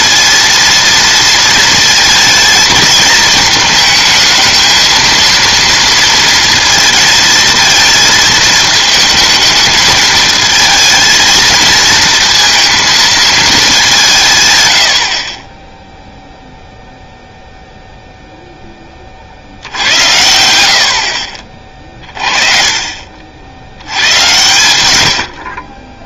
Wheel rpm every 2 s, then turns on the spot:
230, 220, 220, 230, 220, 220, 230, 120, 0, 10, 80, 30, 110.
none